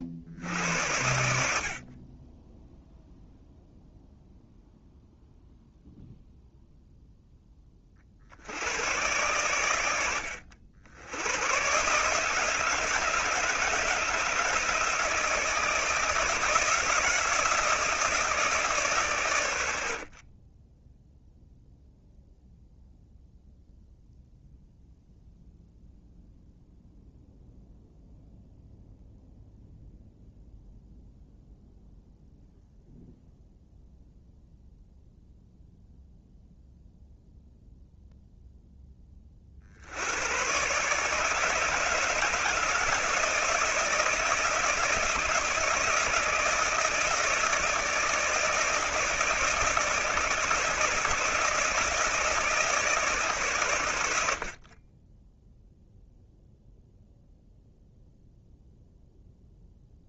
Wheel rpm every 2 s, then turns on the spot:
80, 0, 0, 0, 100, 80, 160, 160, 160, 140, 10, 0, 0, 0, 0, 0, 0, 0, 0, 10, 140, 160, 160, 160, 160, 160, 160, 40, 0, 0.
20-22